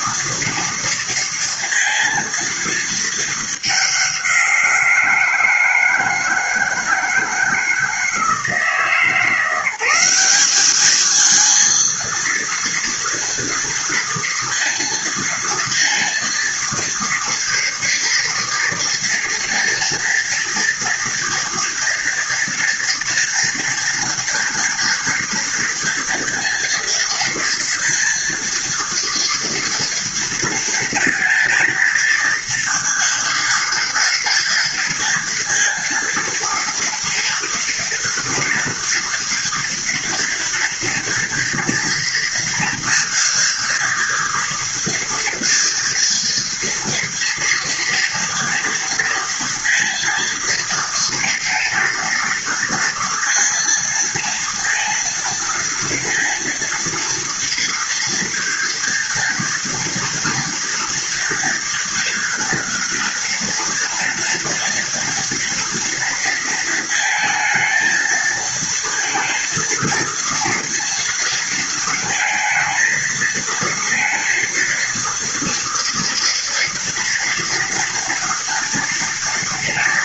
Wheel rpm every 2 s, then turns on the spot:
230, 220, 170, 160, 170, 220, 230, 230, 230, 240, 230, 240, 230, 230, 230, 230, 230, 230, 230, 230, 240, 230, 230, 230, 230, 230, 230, 230, 230, 230, 230, 230, 240, 230, 230, 230, 220, 230, 230, 230.
none